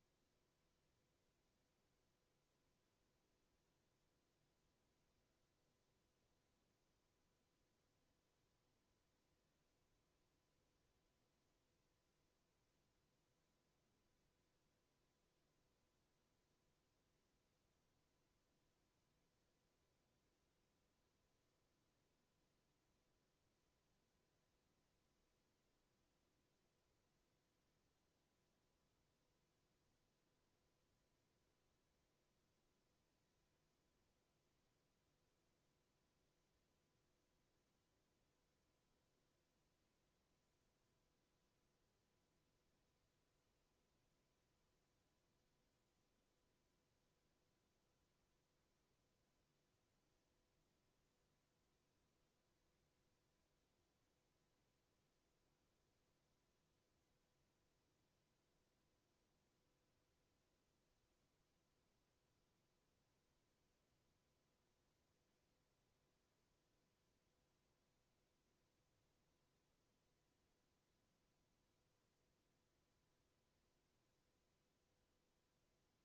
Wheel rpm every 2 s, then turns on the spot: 0, 0, 0, 0, 0, 0, 0, 0, 0, 0, 0, 0, 0, 0, 0, 0, 0, 0, 0, 0, 0, 0, 0, 0, 0, 0, 0, 0, 0, 0, 0, 0, 0, 0, 0, 0, 0, 0.
none